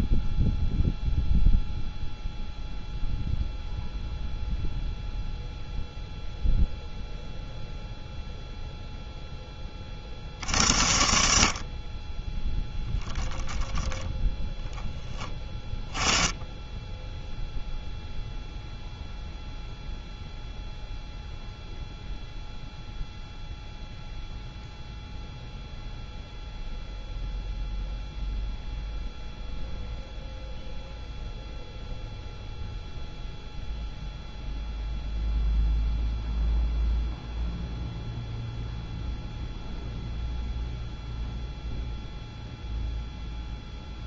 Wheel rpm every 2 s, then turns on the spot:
0, 0, 0, 0, 0, 70, 10, 10, 10, 0, 0, 0, 0, 0, 0, 0, 0, 0, 0, 0, 0, 0.
none